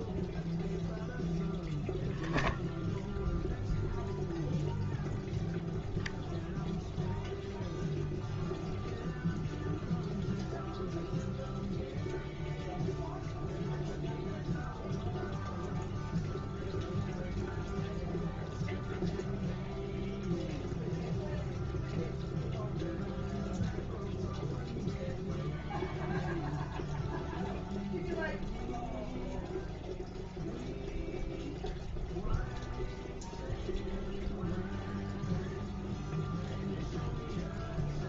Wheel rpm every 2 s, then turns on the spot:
0, 0, 0, 0, 0, 0, 0, 0, 0, 0, 0, 0, 0, 0, 0, 0, 0, 0, 0.
none